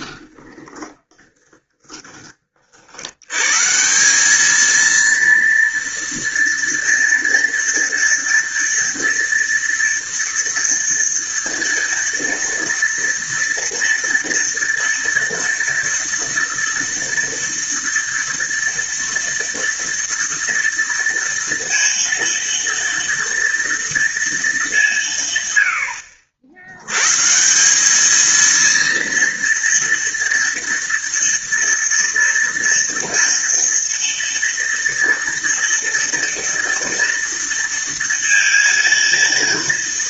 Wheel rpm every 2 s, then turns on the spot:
20, 50, 220, 230, 230, 230, 230, 240, 230, 230, 230, 230, 200, 90, 230, 230, 230, 230, 230, 230.
0-2